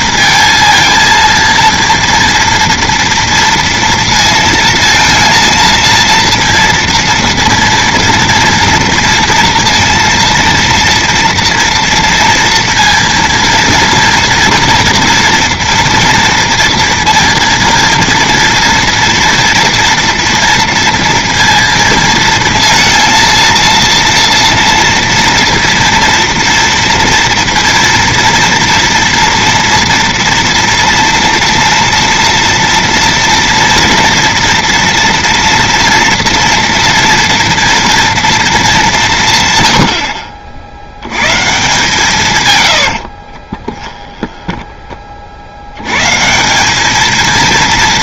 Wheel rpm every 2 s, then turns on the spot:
230, 230, 230, 230, 230, 230, 230, 230, 230, 230, 230, 230, 230, 230, 230, 230, 230, 240, 240, 200, 70, 100, 20, 200.
42-44